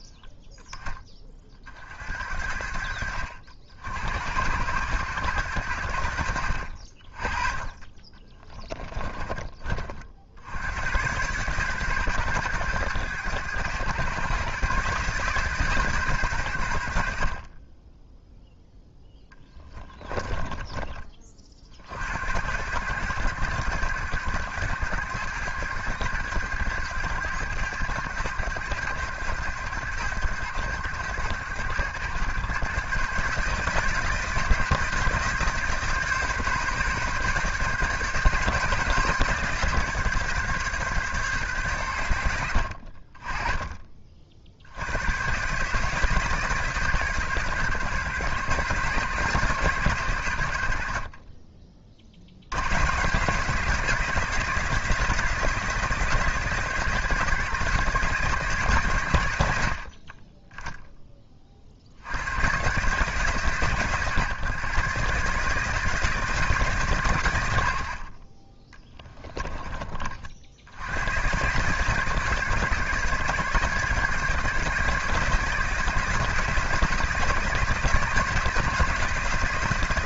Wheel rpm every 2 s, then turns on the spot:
20, 60, 100, 60, 20, 90, 110, 130, 80, 10, 20, 100, 100, 100, 100, 100, 120, 160, 140, 140, 140, 60, 80, 150, 140, 70, 110, 170, 160, 130, 10, 130, 140, 140, 20, 70, 150, 160, 170, 170.
8-10 68-70